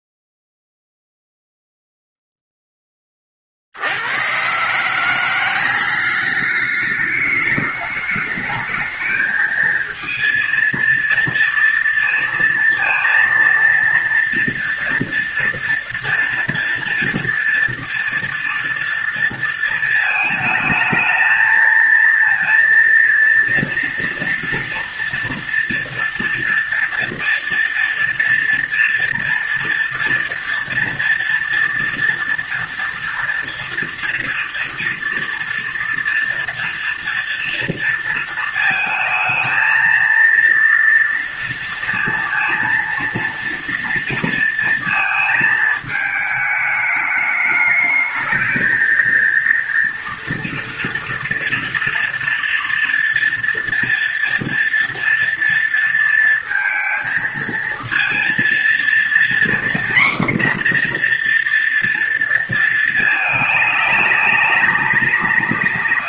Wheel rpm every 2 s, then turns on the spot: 0, 0, 120, 200, 210, 230, 230, 230, 240, 230, 220, 230, 230, 230, 230, 230, 240, 240, 230, 220, 230, 230, 230, 210, 220, 230, 230, 230, 230, 230, 250, 230, 200.
none